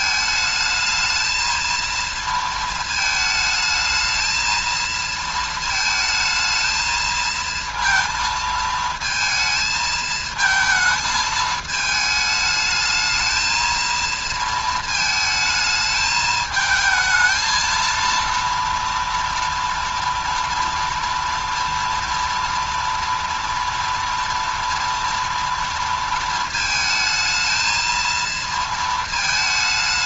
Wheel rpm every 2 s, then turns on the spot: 220, 230, 230, 220, 220, 220, 210, 230, 220, 230, 230, 230, 240, 220, 230.
none